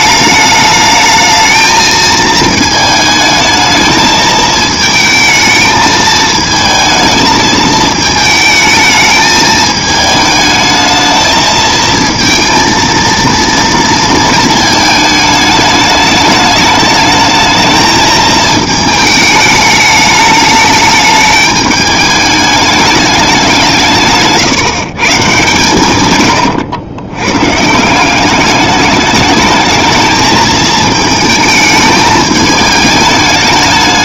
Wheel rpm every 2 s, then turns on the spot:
220, 220, 220, 220, 220, 220, 230, 220, 210, 220, 210, 210, 140, 110, 210, 220, 210.
none